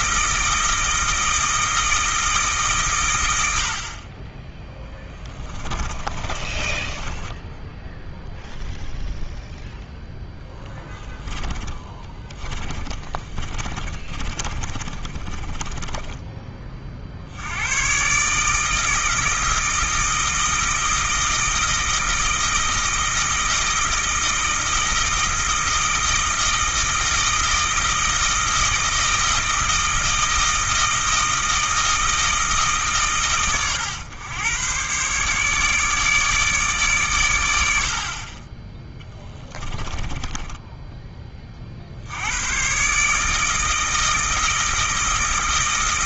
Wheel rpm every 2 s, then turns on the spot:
160, 140, 10, 20, 0, 10, 20, 40, 40, 160, 160, 160, 160, 160, 160, 160, 150, 120, 140, 10, 10, 130, 160.
6-8 10-16 40-42